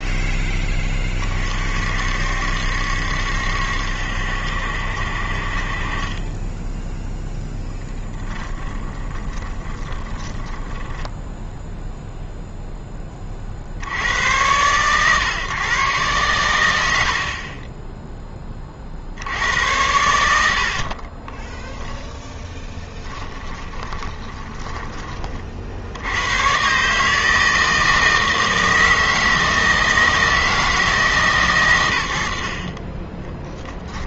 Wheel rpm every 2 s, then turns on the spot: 20, 70, 60, 10, 30, 10, 0, 110, 100, 30, 70, 10, 20, 120, 160, 160, 50.
6-12 20-26